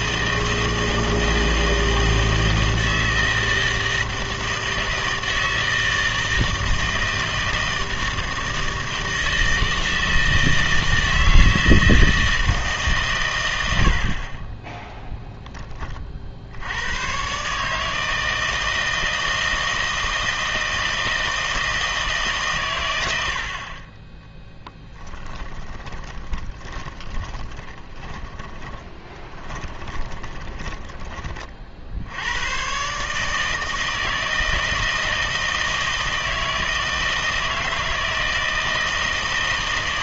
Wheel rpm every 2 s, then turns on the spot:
160, 160, 160, 160, 160, 160, 140, 10, 70, 160, 160, 130, 10, 20, 20, 20, 110, 160, 160, 160.
24-32